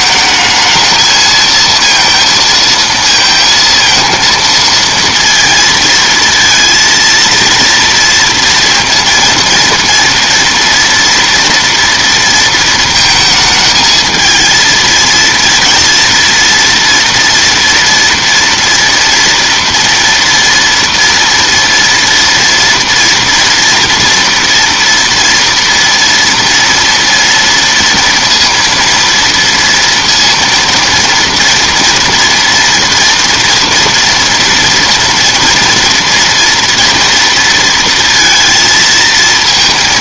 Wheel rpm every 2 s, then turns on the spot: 220, 230, 230, 230, 230, 230, 230, 220, 230, 230, 230, 230, 230, 230, 230, 230, 240, 230, 230, 230.
none